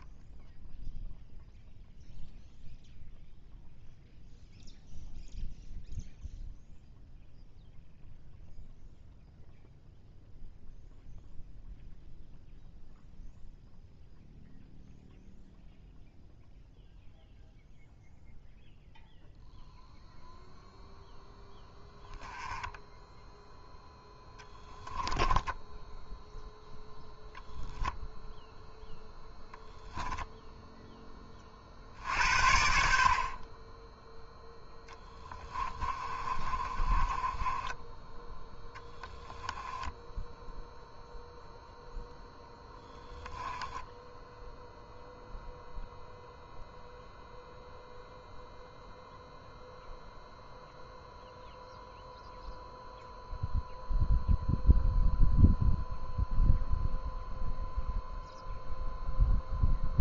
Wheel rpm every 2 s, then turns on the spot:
0, 0, 0, 0, 0, 0, 0, 0, 0, 0, 0, 10, 10, 0, 0, 10, 70, 10, 20, 10, 0, 0, 0, 0, 0, 0, 0, 0, 0, 0.
24-26 34-38